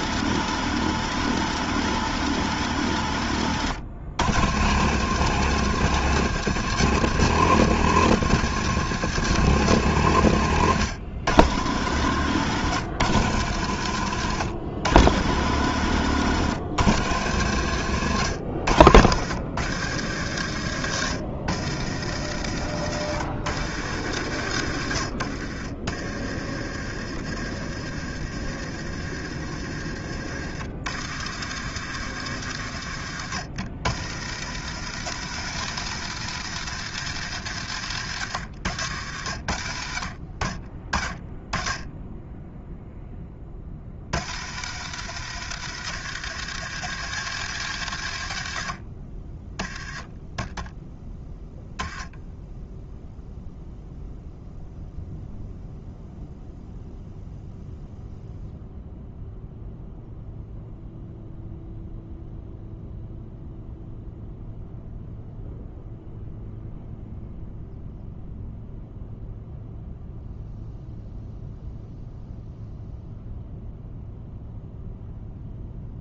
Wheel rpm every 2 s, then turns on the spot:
140, 110, 140, 140, 140, 100, 120, 100, 110, 100, 80, 80, 50, 50, 50, 70, 60, 100, 110, 60, 10, 10, 90, 100, 30, 0, 0, 0, 0, 0, 0, 0, 0, 0, 0, 0, 0, 0.
none